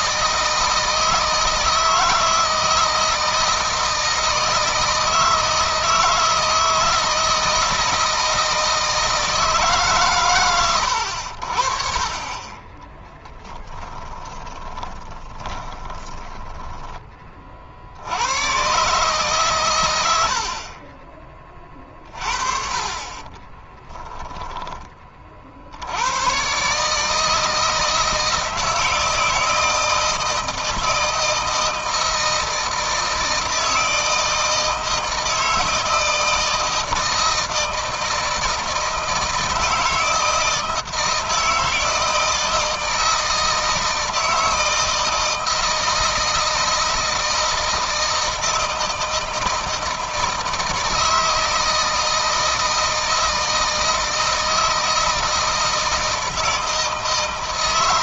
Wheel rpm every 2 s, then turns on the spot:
160, 160, 160, 160, 160, 110, 20, 20, 20, 120, 40, 30, 20, 140, 160, 160, 160, 160, 160, 160, 160, 160, 160, 160, 160, 160, 160, 160, 160.
12-16 22-24